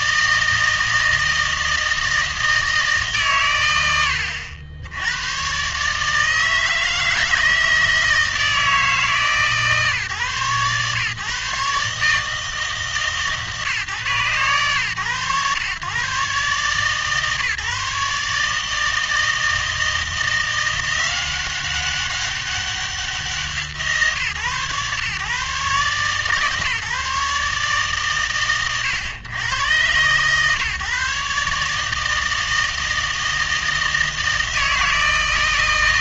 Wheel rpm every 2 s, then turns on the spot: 160, 160, 80, 160, 150, 130, 150, 120, 140, 160, 170, 190, 120, 150, 100, 140, 160, 160.
none